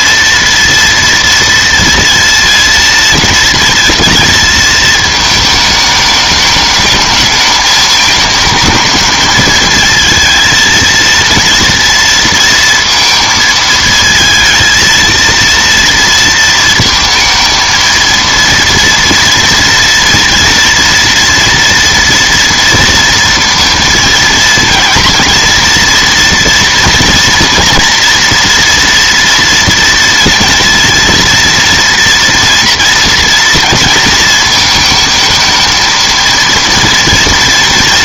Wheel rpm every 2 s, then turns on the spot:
230, 230, 220, 210, 220, 230, 230, 230, 230, 230, 230, 230, 230, 230, 230, 230, 230, 220, 230.
none